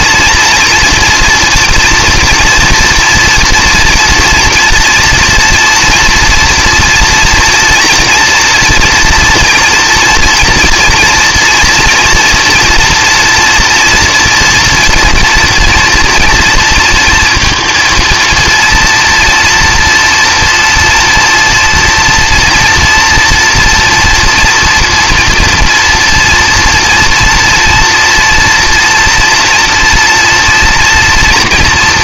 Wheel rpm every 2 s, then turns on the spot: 230, 230, 240, 230, 230, 230, 230, 230, 230, 230, 240, 230, 230, 230, 230, 230.
none